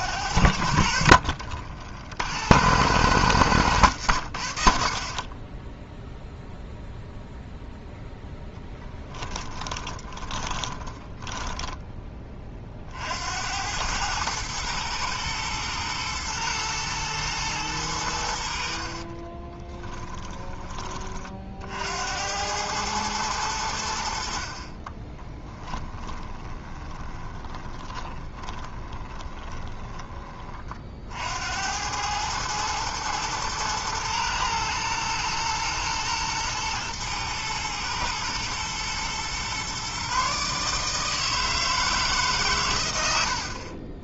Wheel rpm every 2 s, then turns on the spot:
60, 110, 50, 0, 20, 20, 50, 110, 110, 40, 30, 110, 30, 20, 20, 50, 110, 120, 110, 120, 160, 110.
8-12 18-20 24-30